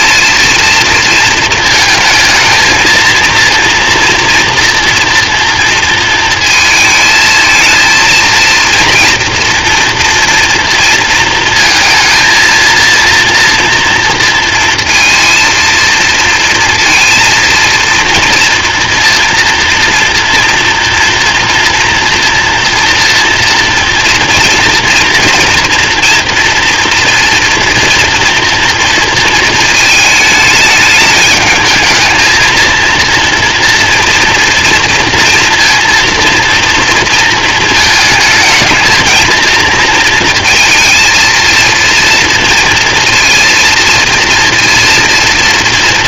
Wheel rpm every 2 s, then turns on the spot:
230, 220, 230, 220, 230, 230, 230, 230, 230, 230, 230, 230, 230, 230, 230, 210, 230, 230, 230, 230, 230, 230, 230.
none